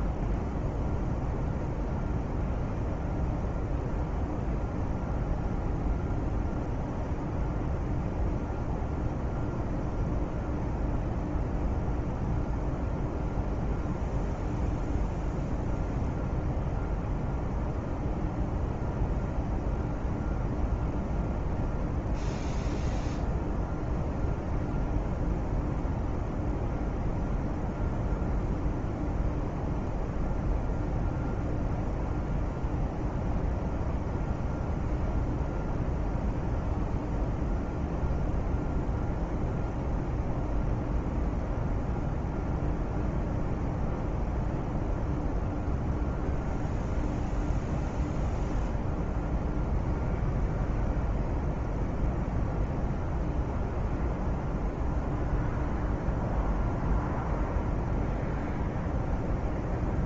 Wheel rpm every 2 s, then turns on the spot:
0, 0, 0, 0, 0, 0, 0, 0, 0, 0, 0, 0, 0, 0, 0, 0, 0, 0, 0, 0, 0, 0, 0, 0, 0, 0, 0, 0, 0, 0.
none